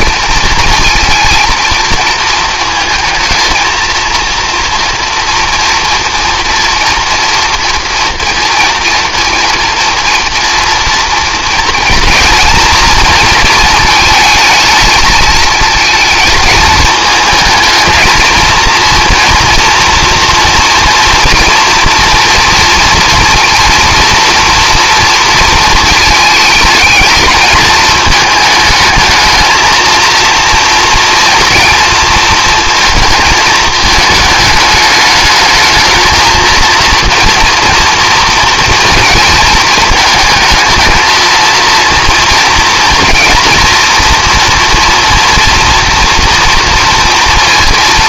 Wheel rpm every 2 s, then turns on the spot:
230, 220, 230, 230, 230, 230, 230, 220, 220, 230, 230, 230, 230, 220, 220, 230, 230, 210, 230, 230, 220, 230, 230, 230.
none